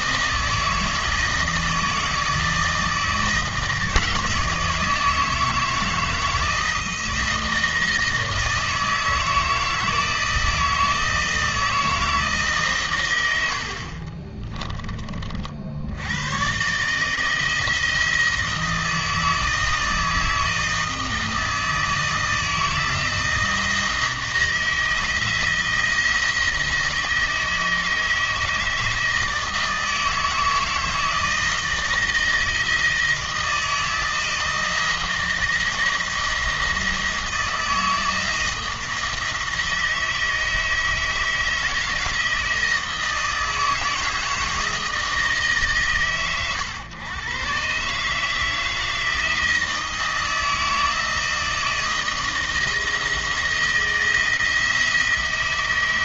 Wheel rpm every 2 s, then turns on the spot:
160, 160, 160, 160, 160, 160, 120, 20, 150, 160, 160, 160, 160, 160, 160, 160, 160, 160, 170, 160, 160, 160, 160, 120, 160, 160, 160, 170.
none